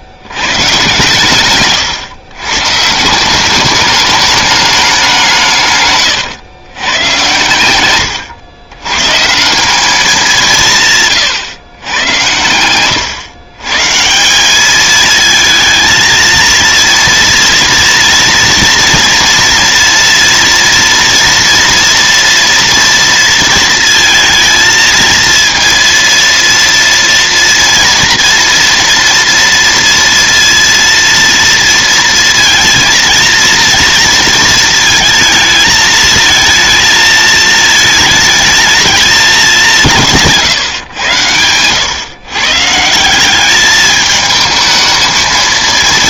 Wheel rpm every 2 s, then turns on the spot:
110, 130, 210, 120, 100, 160, 100, 200, 230, 230, 230, 230, 220, 230, 230, 230, 230, 230, 220, 220, 140, 140, 220.
none